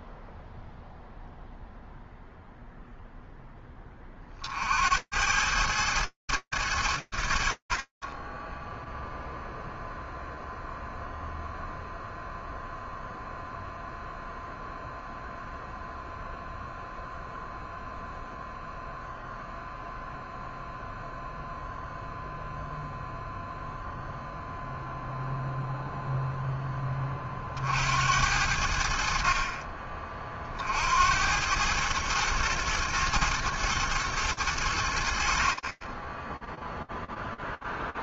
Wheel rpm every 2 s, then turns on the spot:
0, 30, 110, 30, 0, 0, 0, 0, 0, 0, 0, 0, 0, 60, 30, 110, 110, 20, 0.
none